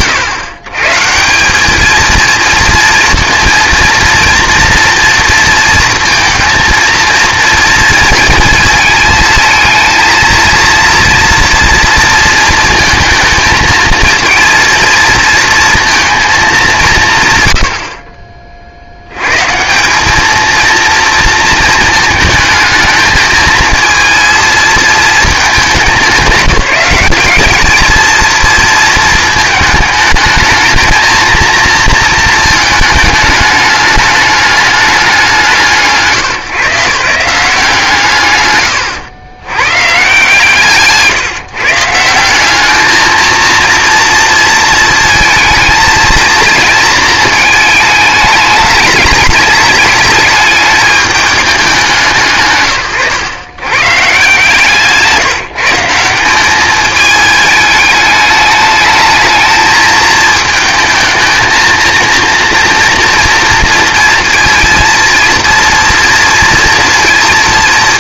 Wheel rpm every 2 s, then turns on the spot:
130, 230, 230, 230, 220, 230, 220, 230, 190, 70, 230, 220, 230, 200, 230, 220, 220, 200, 140, 110, 150, 210, 230, 230, 210, 210, 130, 150, 210, 210, 220, 240, 230, 230.
40-42 54-56